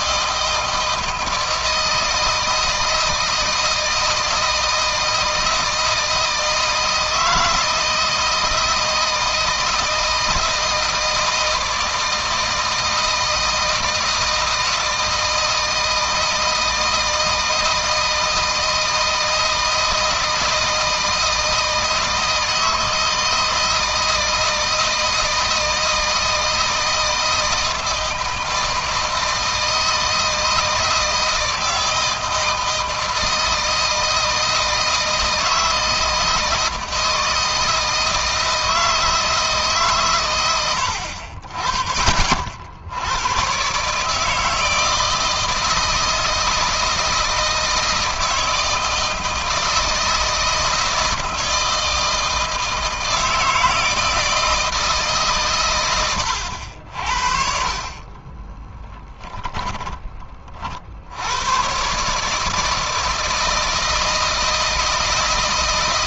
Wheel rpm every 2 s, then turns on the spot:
160, 160, 160, 160, 160, 160, 160, 160, 160, 160, 160, 160, 160, 160, 160, 160, 160, 160, 160, 160, 90, 70, 160, 160, 160, 160, 160, 160, 60, 20, 50, 160, 160.
58-60